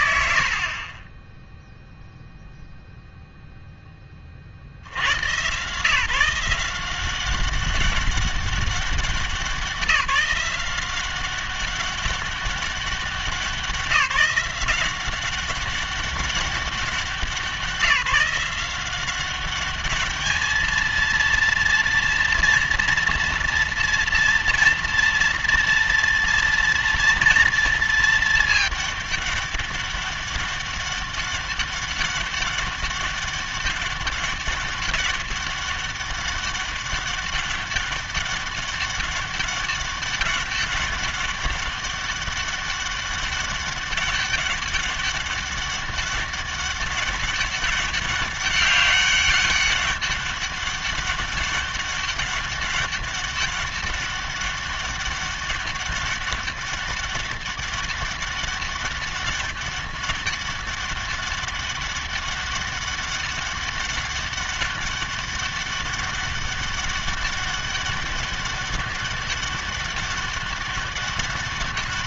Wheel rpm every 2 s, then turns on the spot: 90, 0, 70, 170, 200, 190, 190, 180, 190, 180, 220, 230, 230, 240, 210, 200, 200, 200, 200, 200, 200, 200, 200, 200, 200, 200, 200, 200, 200, 200, 200, 200, 200, 200, 200, 200.
none